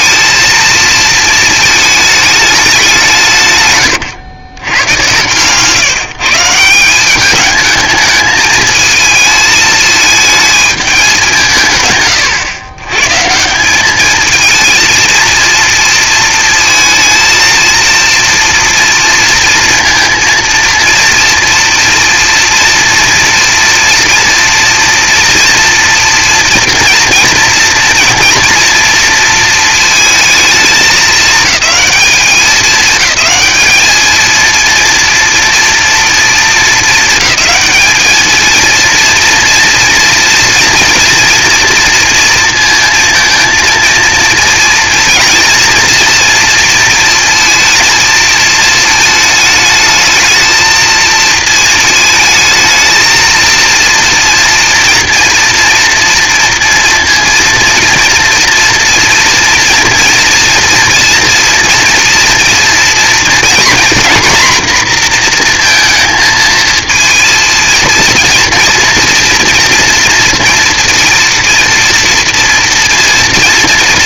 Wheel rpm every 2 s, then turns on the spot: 230, 210, 110, 160, 220, 220, 120, 230, 230, 230, 230, 230, 240, 240, 230, 220, 210, 230, 230, 230, 230, 230, 230, 230, 220, 220, 220, 230, 230, 230, 230, 230, 240, 220, 230, 230, 230.
none